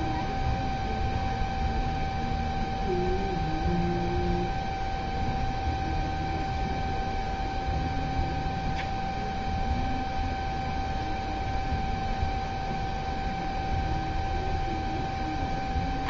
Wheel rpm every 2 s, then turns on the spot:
0, 0, 0, 0, 0, 0, 0, 0.
none